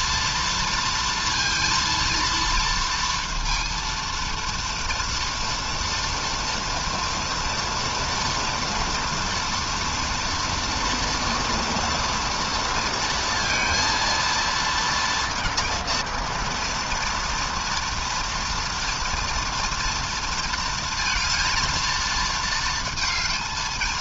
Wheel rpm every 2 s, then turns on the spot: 230, 230, 230, 230, 230, 230, 230, 230, 230, 230, 230, 230.
none